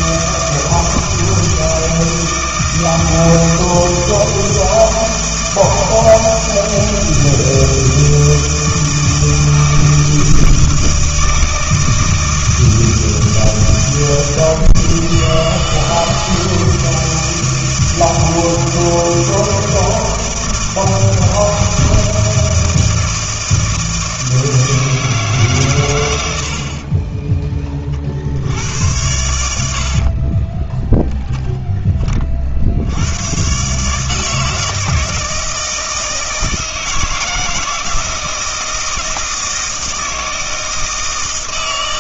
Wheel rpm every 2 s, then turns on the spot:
160, 160, 160, 160, 160, 160, 160, 160, 160, 160, 160, 160, 160, 40, 90, 20, 60, 160, 160, 160, 160.
30-32